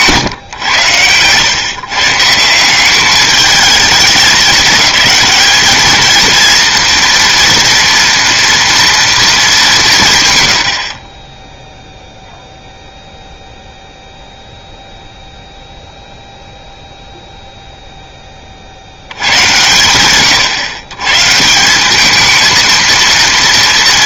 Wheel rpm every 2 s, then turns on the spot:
120, 180, 210, 230, 230, 80, 0, 0, 0, 60, 140, 230.
none